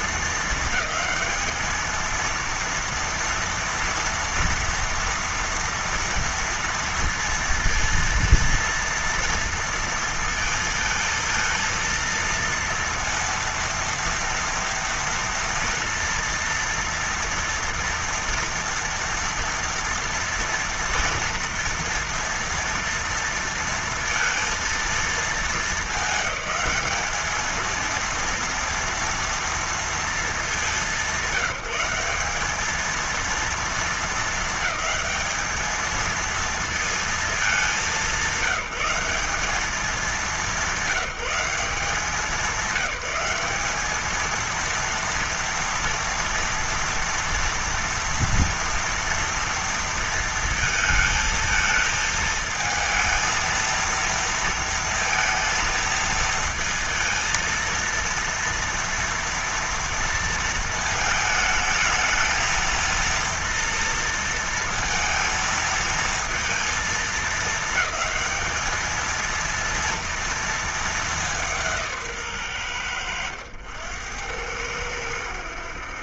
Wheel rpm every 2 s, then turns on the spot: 220, 230, 230, 230, 230, 230, 230, 230, 240, 240, 230, 230, 230, 210, 230, 190, 220, 220, 230, 190, 170, 190, 230, 230, 230, 220, 220, 230, 230, 230, 220, 230, 230, 220, 210, 220, 90, 90.
none